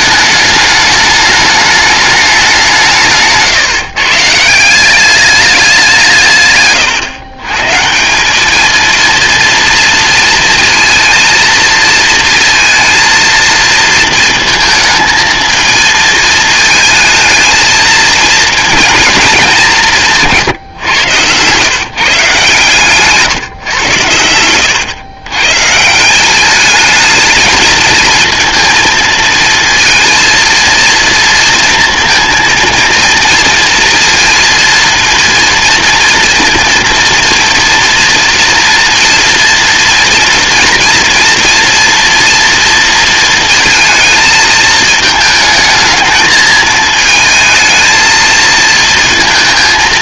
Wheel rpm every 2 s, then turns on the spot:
210, 190, 150, 140, 210, 230, 230, 220, 220, 220, 150, 140, 100, 200, 230, 230, 230, 230, 230, 230, 230, 230, 220, 220, 230.
24-26